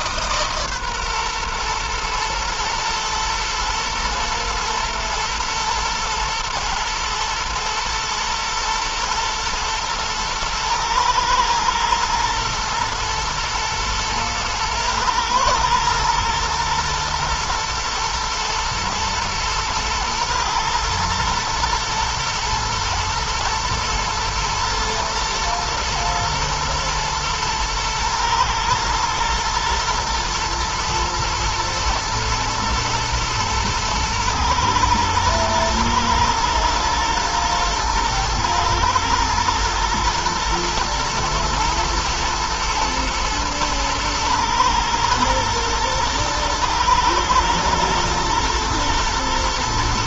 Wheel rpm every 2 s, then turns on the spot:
140, 120, 110, 110, 110, 110, 120, 110, 110, 110, 110, 110, 110, 110, 110, 120, 110, 110, 110, 110, 120, 110, 120, 120, 110.
none